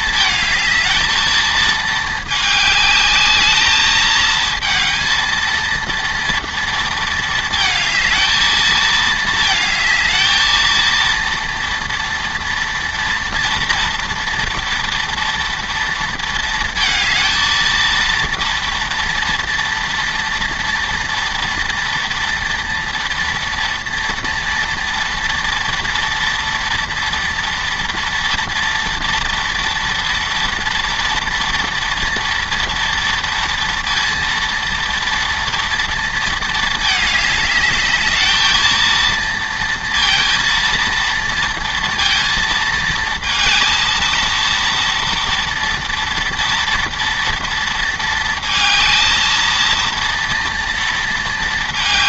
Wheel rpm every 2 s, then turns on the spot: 220, 210, 220, 230, 220, 230, 230, 230, 220, 230, 230, 230, 230, 230, 230, 240, 230, 230, 220, 220, 230, 230, 230, 230, 220, 230.
none